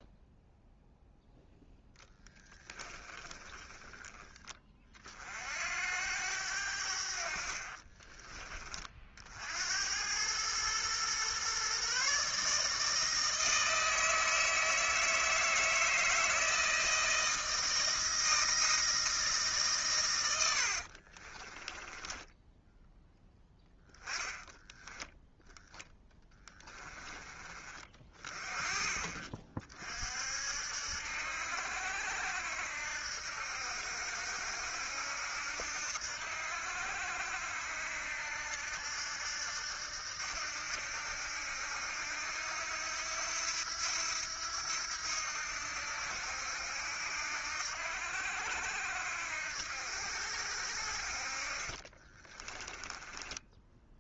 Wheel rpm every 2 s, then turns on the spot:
0, 10, 40, 70, 40, 120, 160, 160, 160, 160, 50, 10, 10, 10, 30, 70, 80, 80, 80, 80, 80, 80, 80, 80, 80, 60, 10.
2-4 20-22 52-54